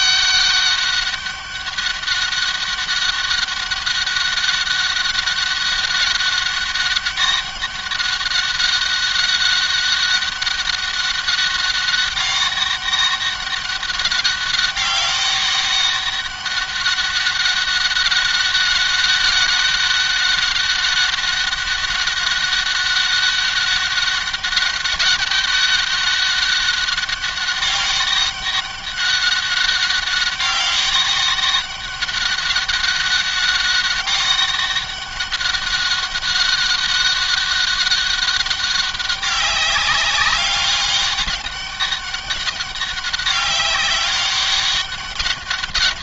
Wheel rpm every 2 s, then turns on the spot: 200, 200, 190, 200, 200, 200, 200, 200, 200, 200, 200, 200, 200, 200, 190, 200, 200, 200, 200, 200, 200, 190, 200.
none